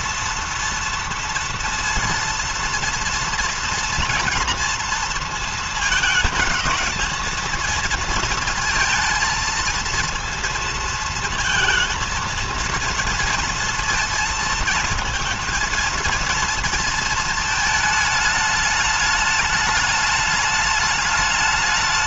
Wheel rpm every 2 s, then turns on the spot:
230, 230, 230, 220, 230, 230, 230, 230, 230, 210, 210.
none